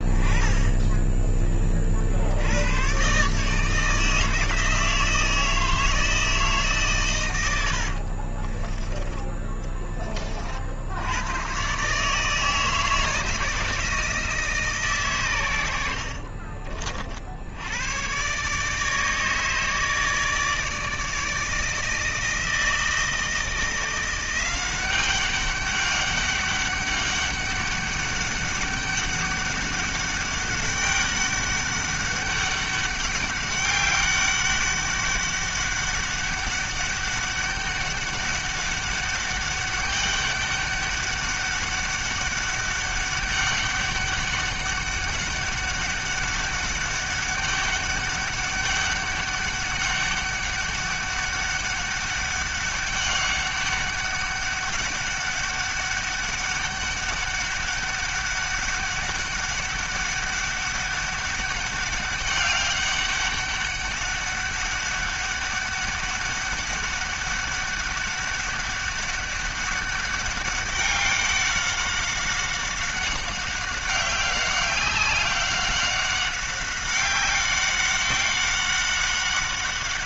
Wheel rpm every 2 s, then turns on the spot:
20, 90, 160, 150, 30, 50, 160, 150, 40, 130, 160, 160, 180, 200, 200, 200, 200, 200, 200, 200, 200, 200, 200, 200, 200, 200, 200, 200, 200, 200, 200, 200, 200, 200, 200, 200, 190, 190, 190, 190.
0-2 8-10 16-18